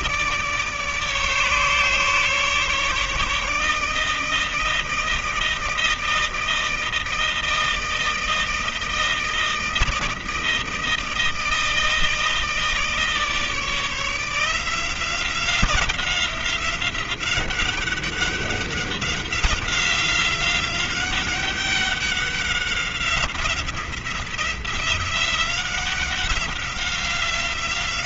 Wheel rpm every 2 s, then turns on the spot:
150, 150, 160, 160, 160, 160, 160, 170, 190, 190, 190, 190, 180, 190.
none